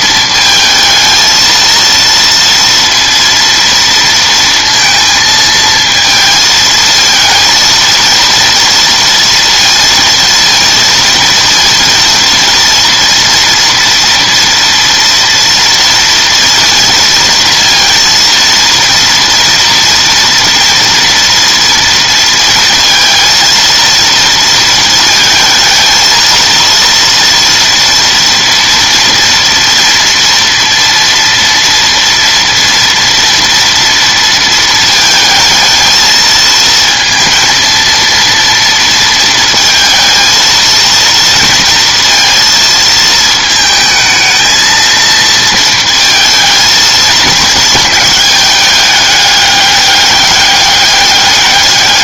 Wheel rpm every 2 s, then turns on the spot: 220, 230, 230, 220, 230, 230, 230, 240, 230, 230, 230, 230, 230, 230, 230, 230, 230, 220, 220, 230, 230, 230, 230, 220, 210, 200.
none